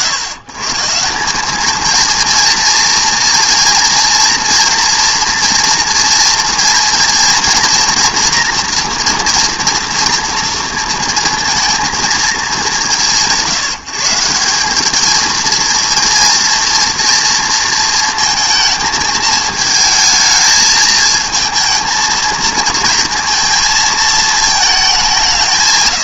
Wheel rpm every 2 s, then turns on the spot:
150, 230, 230, 230, 230, 230, 190, 170, 230, 220, 220, 230, 220.
none